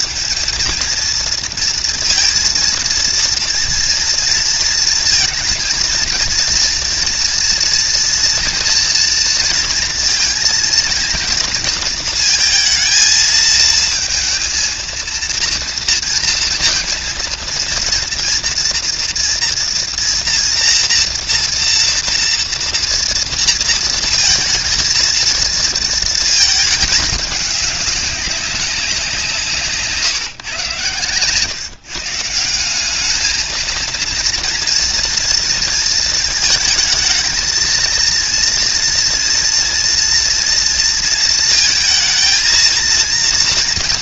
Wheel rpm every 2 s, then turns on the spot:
220, 230, 230, 230, 240, 230, 220, 230, 230, 240, 230, 230, 230, 220, 190, 130, 190, 230, 220, 230, 230, 230.
none